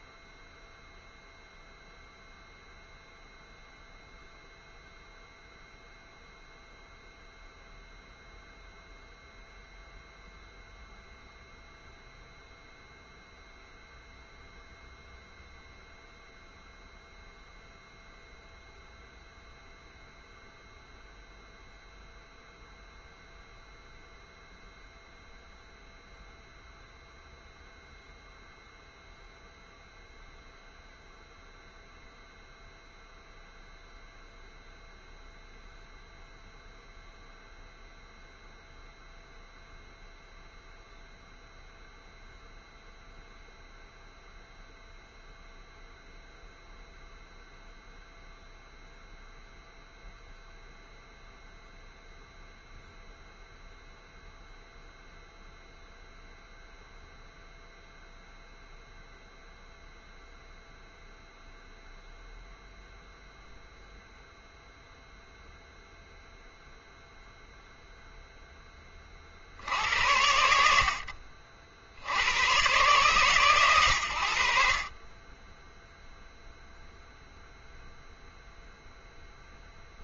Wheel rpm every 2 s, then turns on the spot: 0, 0, 0, 0, 0, 0, 0, 0, 0, 0, 0, 0, 0, 0, 0, 0, 0, 0, 0, 0, 0, 0, 0, 0, 0, 0, 0, 0, 0, 0, 0, 0, 0, 0, 10, 80, 120, 50, 0, 0.
none